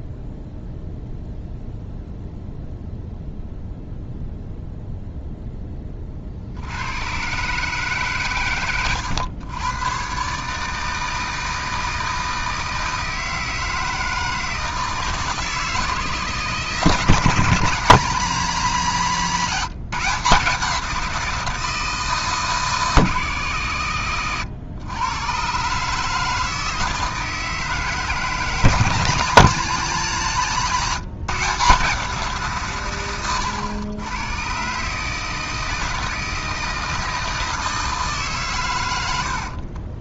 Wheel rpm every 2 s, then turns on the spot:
0, 0, 0, 70, 110, 150, 160, 160, 150, 180, 170, 150, 110, 160, 160, 160, 130, 140, 160, 120.
none